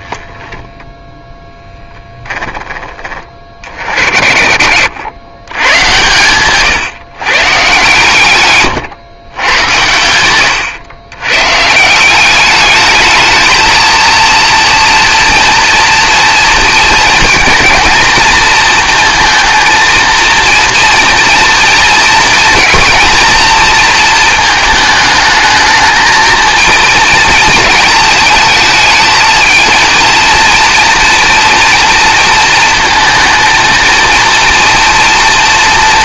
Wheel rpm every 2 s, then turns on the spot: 10, 10, 60, 130, 120, 110, 220, 230, 220, 230, 230, 230, 220, 230, 220, 230, 220, 240.
0-2 4-6 8-10